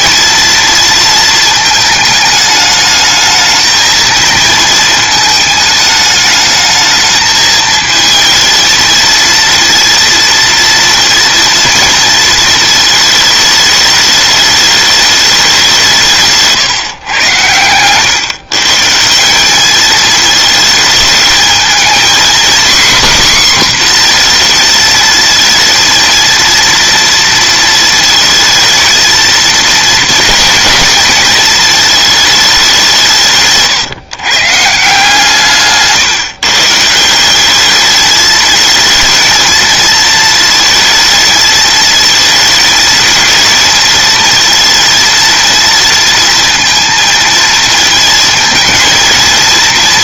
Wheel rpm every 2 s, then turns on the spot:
230, 210, 220, 220, 230, 230, 220, 210, 140, 140, 220, 260, 230, 230, 230, 230, 180, 150, 160, 230, 220, 220, 230, 230, 230.
none